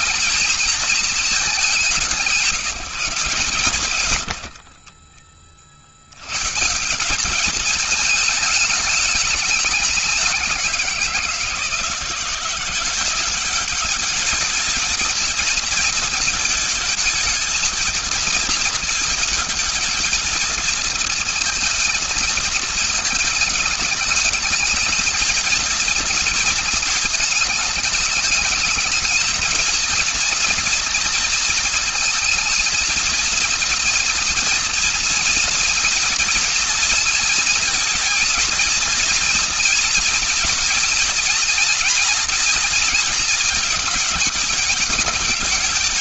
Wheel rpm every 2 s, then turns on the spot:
190, 120, 40, 210, 200, 170, 200, 230, 220, 220, 230, 220, 230, 220, 220, 220, 230, 230, 220, 240, 240, 220, 210.
none